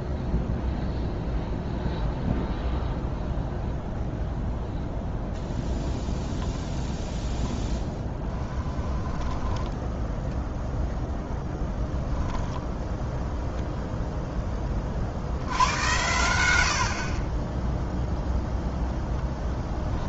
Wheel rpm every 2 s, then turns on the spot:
0, 0, 0, 10, 10, 0, 0, 30, 70, 0.
8-10